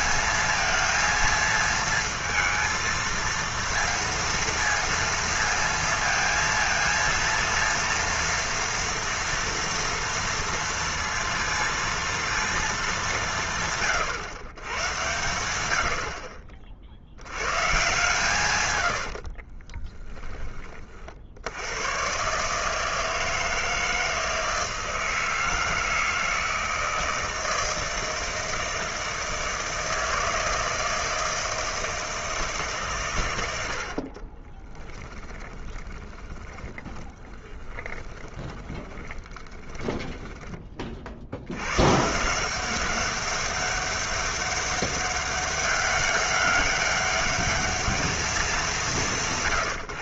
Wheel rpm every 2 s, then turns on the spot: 230, 230, 230, 230, 230, 230, 230, 130, 50, 130, 10, 140, 160, 160, 160, 160, 160, 30, 30, 20, 10, 170, 200, 200, 180.
34-40